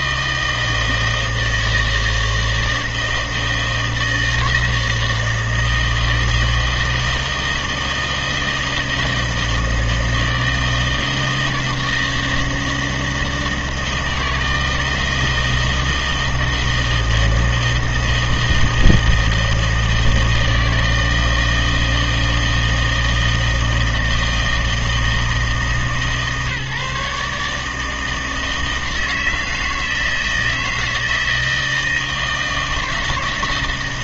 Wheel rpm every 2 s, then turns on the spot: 160, 160, 160, 160, 160, 160, 160, 160, 160, 160, 160, 160, 160, 150, 160, 160, 160.
none